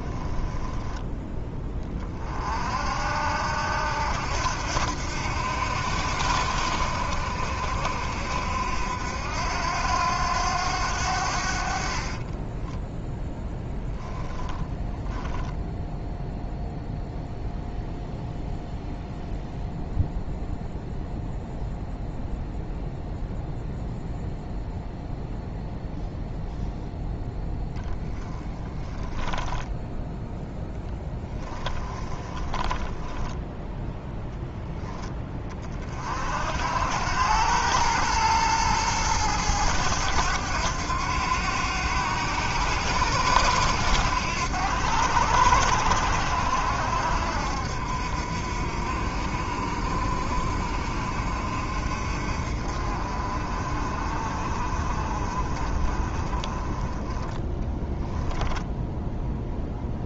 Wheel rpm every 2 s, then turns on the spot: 10, 50, 80, 70, 70, 90, 10, 10, 0, 0, 0, 0, 0, 0, 10, 0, 20, 10, 70, 110, 100, 90, 90, 80, 60, 50, 50, 40, 20, 10.
0-2 12-14 28-30 32-34